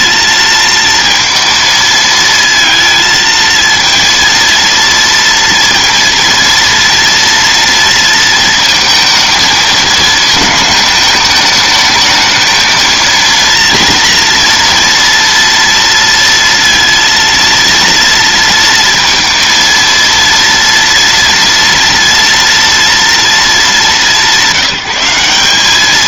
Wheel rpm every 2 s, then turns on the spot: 230, 230, 230, 230, 220, 220, 220, 230, 230, 230, 230, 230, 190.
none